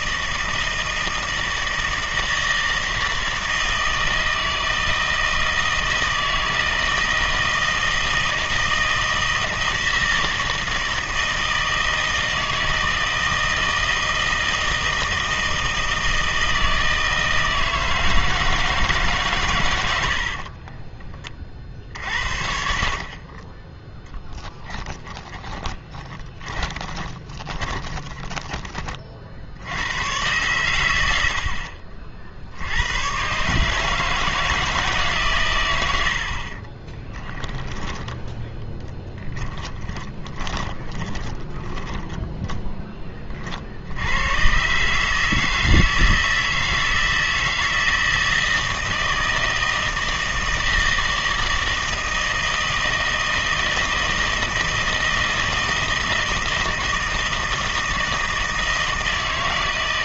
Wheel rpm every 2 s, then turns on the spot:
160, 160, 160, 160, 160, 160, 160, 160, 160, 160, 30, 50, 10, 20, 30, 110, 80, 160, 30, 10, 20, 10, 130, 160, 160, 160, 160, 160, 160, 160.
20-22 24-28 36-42